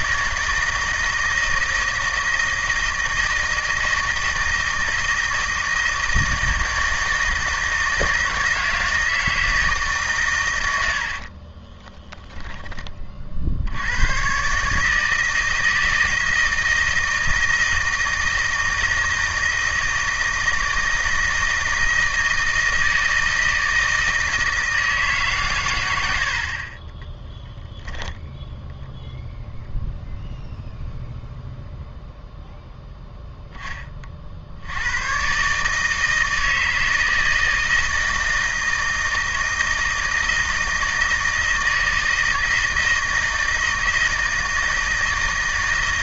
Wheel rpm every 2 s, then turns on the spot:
160, 160, 160, 160, 160, 90, 20, 140, 160, 160, 160, 160, 160, 40, 0, 0, 0, 80, 160, 160, 160, 160, 160.
none